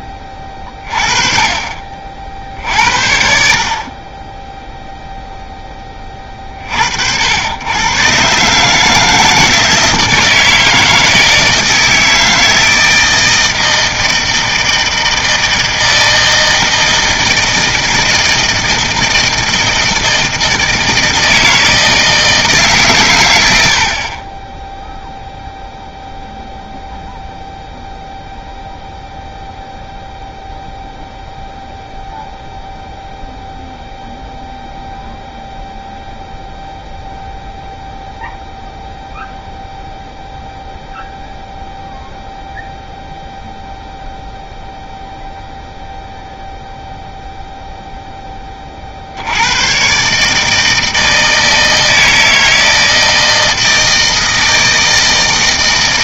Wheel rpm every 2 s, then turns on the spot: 30, 60, 0, 60, 150, 160, 160, 160, 160, 160, 160, 140, 10, 0, 0, 0, 0, 0, 0, 0, 0, 0, 0, 0, 30, 160, 160, 160.
none